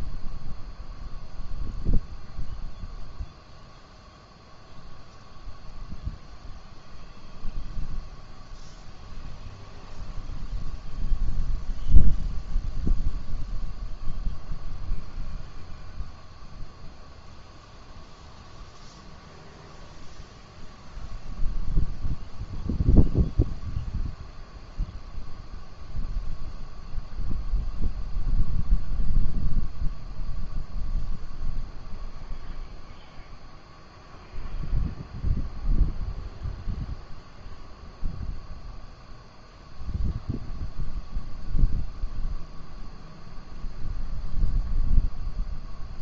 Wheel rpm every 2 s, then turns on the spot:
0, 0, 0, 0, 0, 0, 0, 0, 0, 0, 0, 0, 0, 0, 0, 0, 0, 0, 0, 0, 0, 0, 0.
none